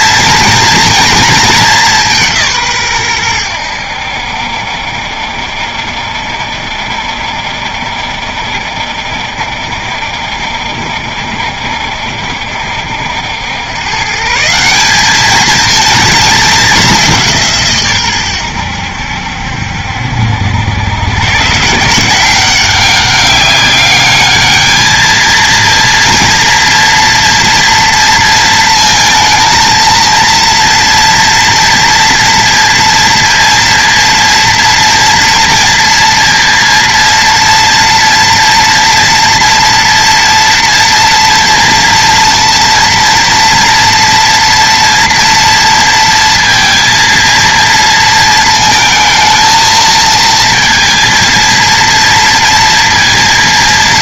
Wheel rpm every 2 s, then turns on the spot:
230, 130, 70, 70, 70, 60, 70, 190, 200, 80, 100, 190, 220, 230, 230, 230, 230, 230, 230, 230, 230, 230, 230, 230, 220, 230, 230.
none